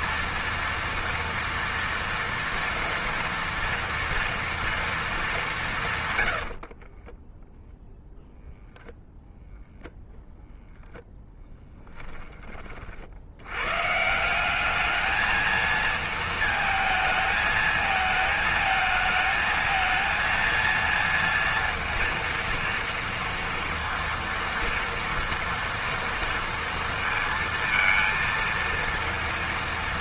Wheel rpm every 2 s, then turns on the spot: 230, 230, 230, 40, 0, 0, 40, 210, 220, 220, 230, 230, 230, 230, 230.
6-8